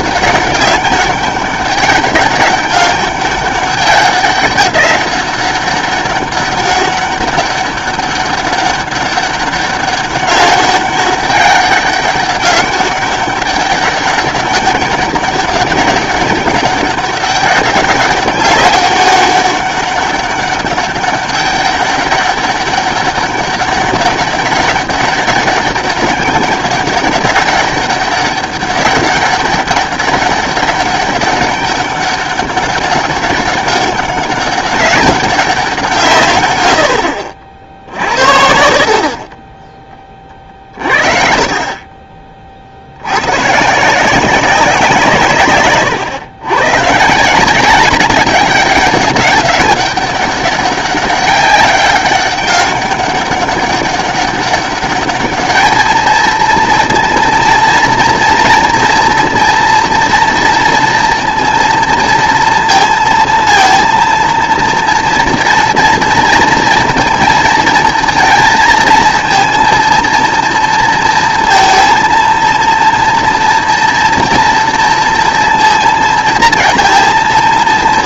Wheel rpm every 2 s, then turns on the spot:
200, 200, 190, 200, 200, 200, 200, 190, 200, 200, 200, 190, 200, 200, 200, 200, 200, 200, 100, 60, 40, 50, 180, 120, 200, 200, 200, 200, 230, 230, 230, 230, 230, 230, 230, 230, 230, 230, 230.
none